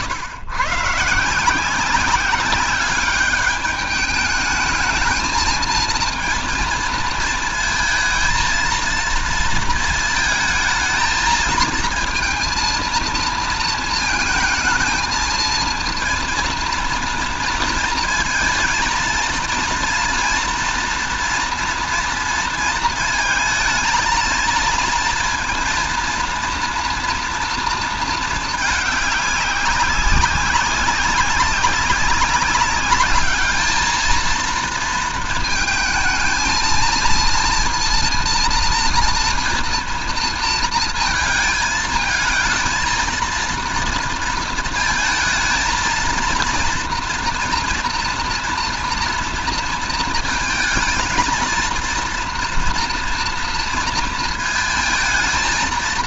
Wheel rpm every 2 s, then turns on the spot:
130, 200, 220, 230, 220, 220, 230, 220, 230, 230, 230, 230, 230, 230, 210, 190, 200, 230, 230, 230, 230, 220, 230, 230, 230, 220, 230, 220.
none